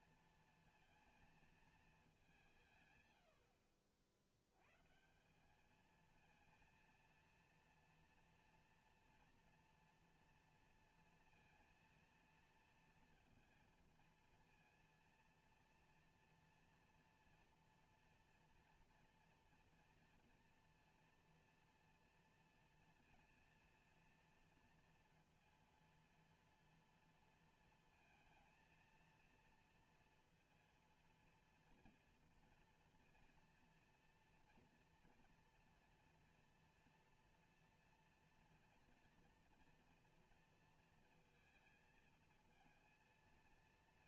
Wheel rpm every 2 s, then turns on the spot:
230, 150, 120, 230, 230, 230, 230, 230, 230, 230, 230, 230, 230, 230, 220, 230, 230, 230, 240, 230, 230, 230.
none